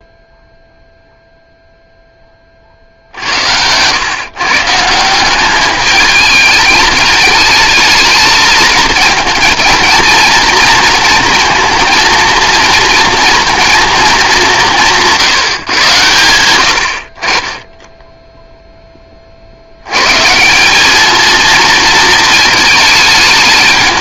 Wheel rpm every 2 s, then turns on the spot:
0, 60, 160, 210, 230, 230, 230, 170, 70, 10, 190, 210.
none